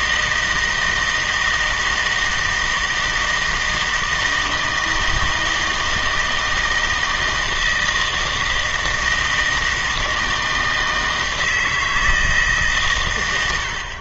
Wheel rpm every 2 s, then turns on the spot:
160, 160, 160, 160, 160, 160, 140.
none